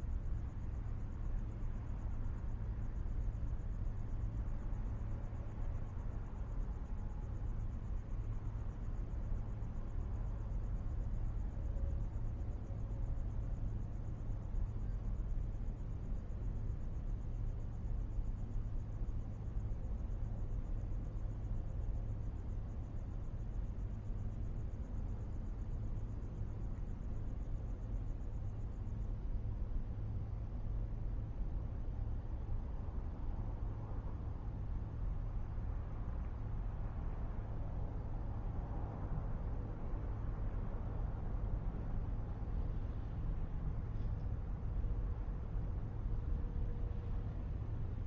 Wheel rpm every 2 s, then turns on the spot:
0, 0, 0, 0, 0, 0, 0, 0, 0, 0, 0, 0, 0, 0, 0, 0, 0, 0, 0, 0, 0, 0, 0, 0.
none